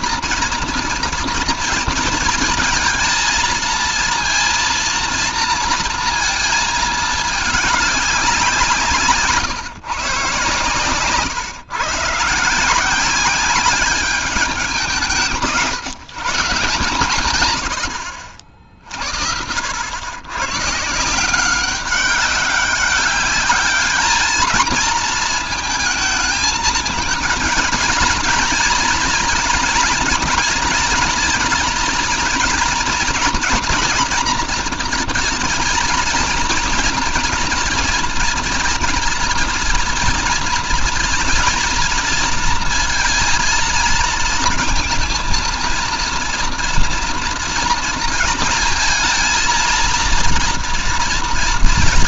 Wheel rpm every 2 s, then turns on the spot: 230, 230, 230, 220, 150, 140, 190, 180, 140, 60, 160, 200, 220, 220, 240, 230, 240, 230, 240, 230, 230, 230, 230, 230, 230, 230.
none